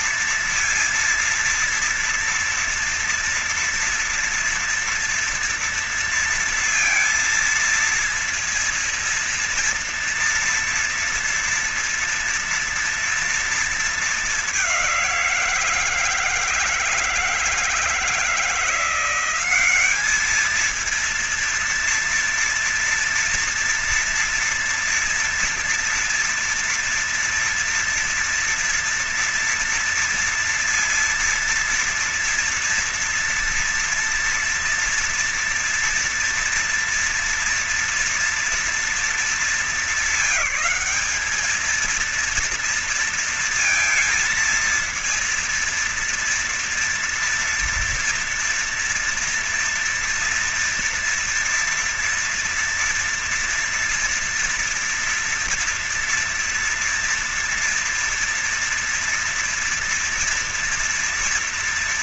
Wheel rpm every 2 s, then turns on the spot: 230, 230, 230, 230, 230, 230, 240, 200, 160, 170, 210, 230, 230, 230, 230, 230, 230, 240, 240, 240, 200, 230, 230, 230, 230, 230, 230, 230, 230, 230, 230.
none